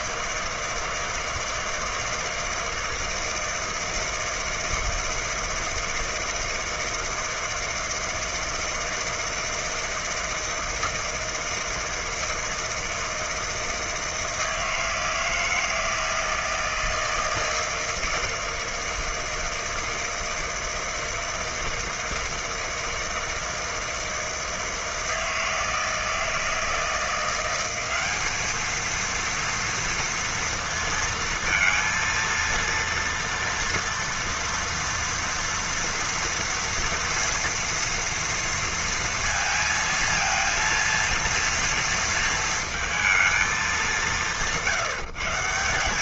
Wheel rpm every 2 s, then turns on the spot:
160, 160, 160, 160, 160, 160, 160, 160, 160, 160, 160, 160, 160, 160, 220, 230, 230, 240, 230, 230, 230, 230, 160.
none